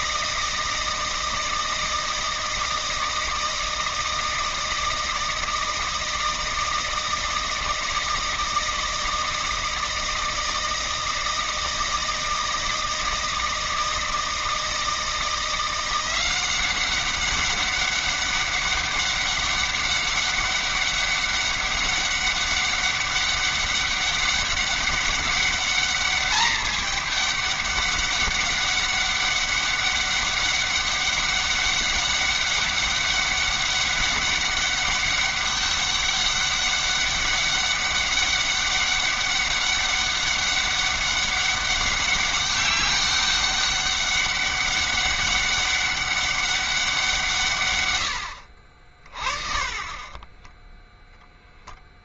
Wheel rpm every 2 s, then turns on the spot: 160, 160, 170, 160, 160, 160, 160, 160, 190, 200, 200, 200, 200, 210, 200, 200, 200, 200, 200, 200, 200, 200, 200, 190, 70, 20.
48-52